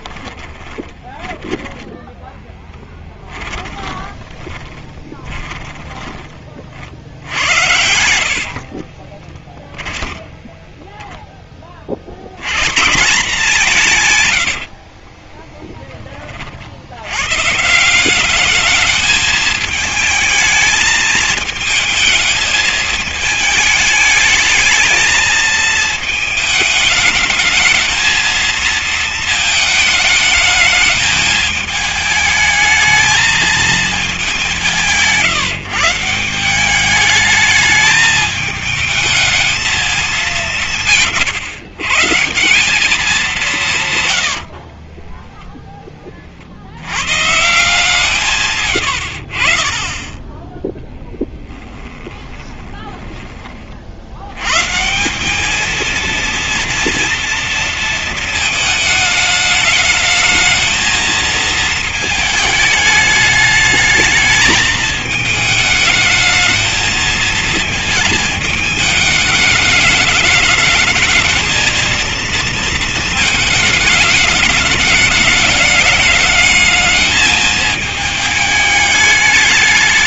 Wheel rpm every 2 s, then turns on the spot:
20, 10, 20, 40, 50, 10, 130, 80, 60, 210, 220, 220, 220, 220, 220, 220, 220, 180, 190, 220, 190, 190, 60, 60, 120, 10, 20, 120, 230, 220, 220, 220, 220, 220, 220, 220, 230, 210, 220, 210.
0-6 8-10 14-16 44-46 48-50 52-54